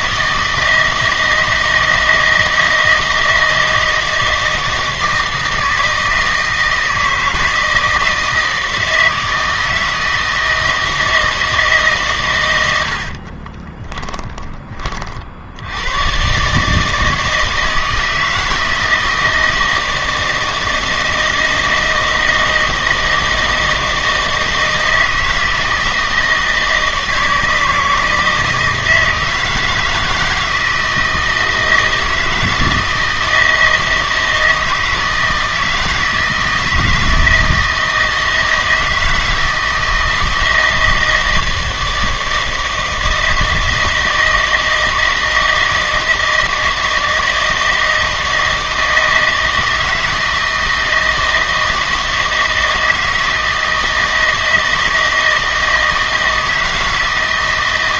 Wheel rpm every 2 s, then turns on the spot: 160, 160, 160, 160, 160, 160, 90, 40, 150, 160, 160, 160, 160, 160, 160, 160, 160, 160, 160, 160, 160, 160, 160, 160, 160, 160, 160, 160, 160.
none